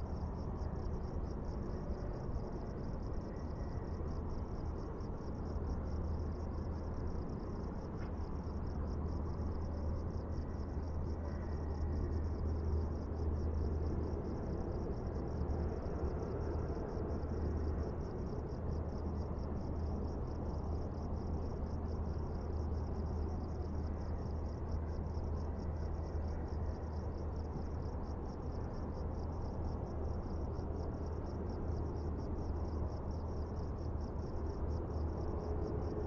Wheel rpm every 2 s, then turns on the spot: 0, 0, 0, 0, 0, 0, 0, 0, 0, 0, 0, 0, 0, 0, 0, 0, 0, 0.
none